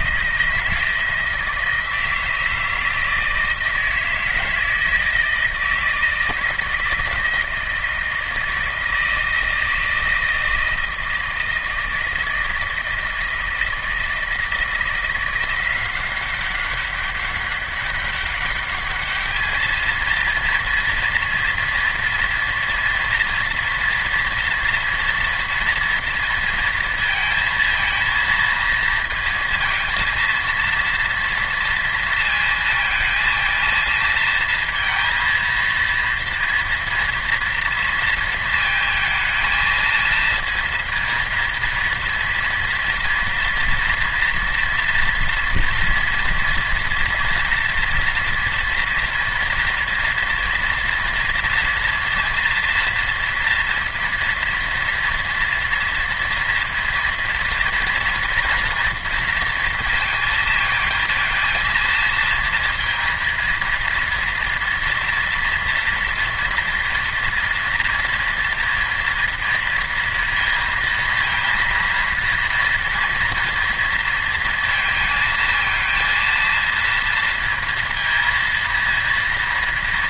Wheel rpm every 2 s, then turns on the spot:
160, 160, 160, 160, 160, 160, 160, 170, 200, 210, 230, 230, 230, 230, 230, 230, 230, 230, 230, 230, 230, 230, 230, 240, 230, 230, 230, 230, 230, 230, 220, 230, 230, 230, 230, 230, 230, 230, 230, 230.
none